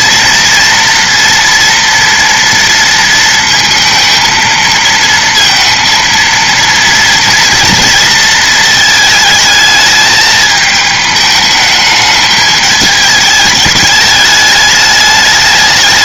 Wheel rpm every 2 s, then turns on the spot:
230, 230, 230, 230, 220, 210, 210, 210.
none